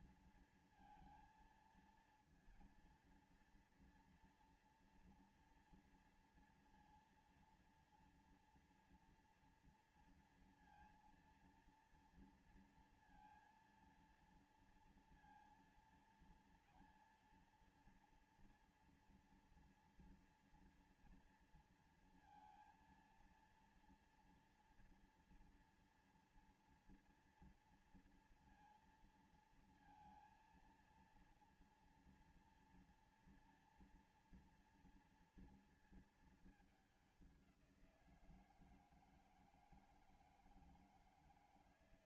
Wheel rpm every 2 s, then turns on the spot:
230, 230, 230, 240, 230, 230, 230, 230, 230, 230, 230, 230, 230, 230, 230, 230, 230, 230, 230, 190, 160.
none